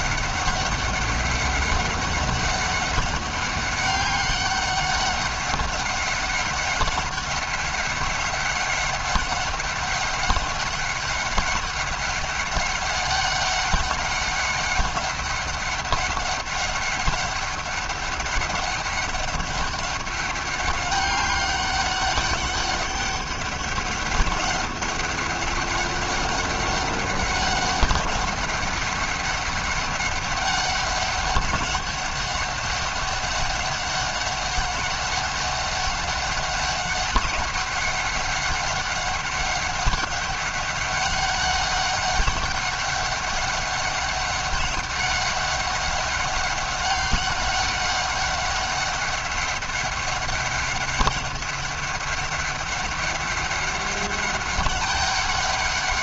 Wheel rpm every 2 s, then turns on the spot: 200, 200, 200, 190, 200, 190, 200, 200, 190, 200, 200, 200, 200, 200, 190, 200, 200, 200, 190, 190, 200, 200, 200, 190, 200, 200, 200, 200.
none